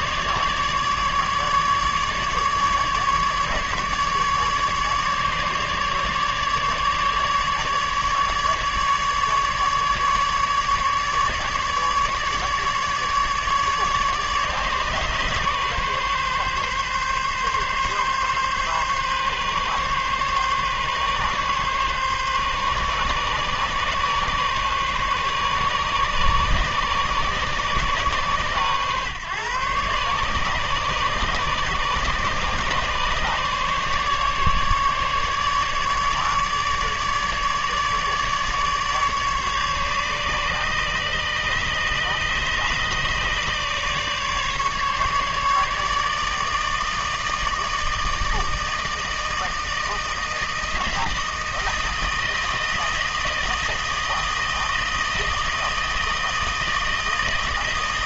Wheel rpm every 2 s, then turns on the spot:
150, 150, 150, 150, 150, 150, 150, 140, 140, 140, 140, 140, 140, 140, 130, 140, 140, 150, 150, 150, 140, 140, 150, 160, 160, 160, 160, 160, 160.
none